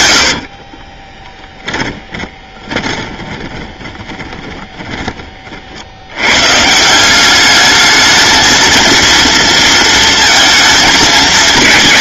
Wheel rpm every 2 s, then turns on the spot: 40, 20, 30, 160, 230, 220.
0-6